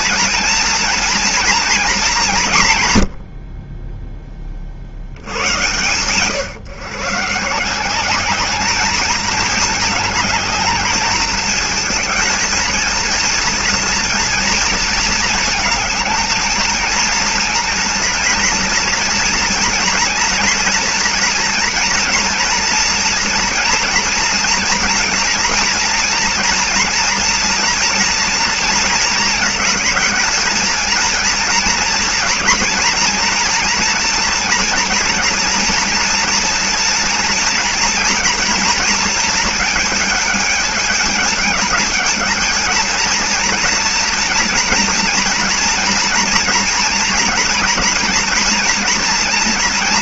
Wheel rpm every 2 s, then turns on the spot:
230, 170, 30, 130, 210, 210, 230, 230, 220, 240, 230, 240, 240, 240, 230, 220, 230, 230, 230, 230, 210, 220, 230, 240, 240.
none